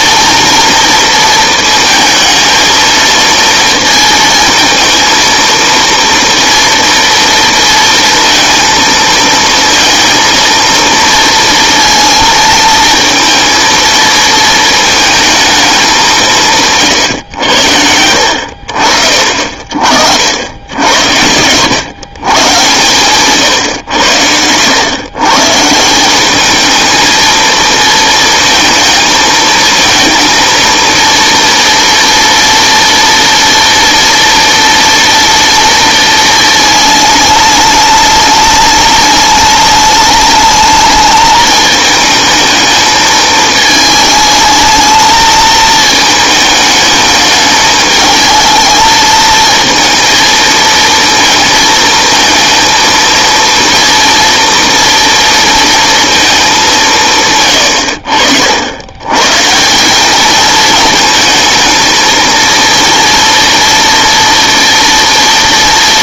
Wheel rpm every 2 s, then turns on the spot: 220, 230, 230, 230, 230, 230, 230, 220, 90, 50, 100, 130, 150, 230, 230, 230, 230, 230, 210, 210, 220, 220, 220, 210, 220, 220, 230, 230, 120, 160, 220, 230, 230.
22-24